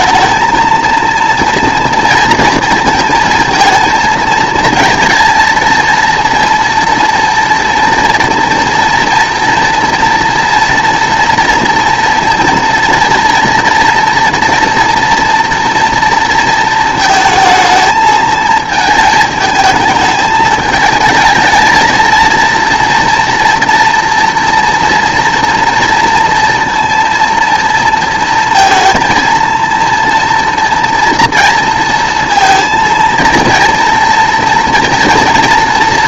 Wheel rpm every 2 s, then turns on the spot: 230, 230, 220, 230, 230, 230, 230, 230, 230, 220, 220, 230, 230, 230, 230, 230, 230, 230.
none